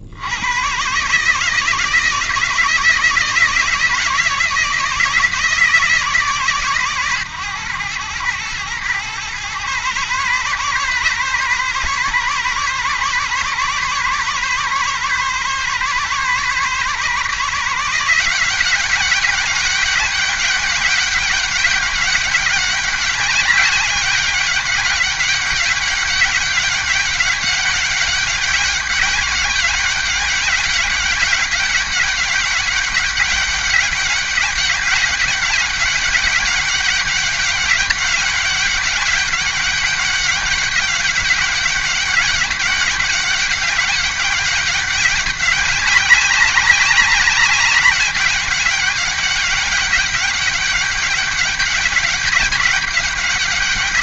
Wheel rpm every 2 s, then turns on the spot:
80, 160, 160, 150, 110, 130, 140, 140, 140, 180, 200, 200, 200, 200, 190, 200, 200, 200, 200, 200, 200, 200, 200, 200, 200, 200, 200.
none